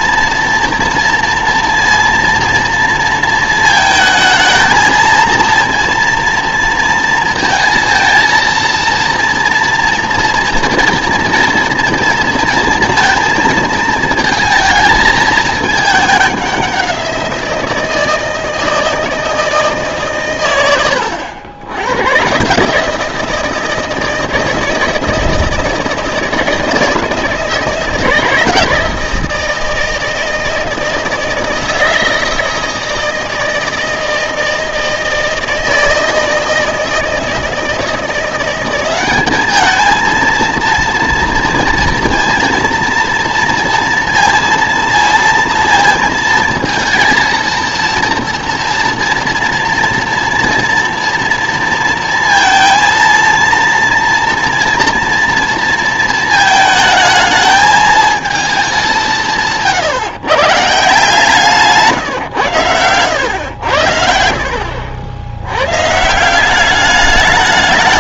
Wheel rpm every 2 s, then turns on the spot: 230, 230, 220, 230, 230, 240, 230, 220, 190, 160, 100, 150, 160, 160, 160, 160, 160, 160, 160, 190, 230, 230, 230, 230, 230, 230, 230, 230, 220, 210, 150, 110, 70, 200.
64-66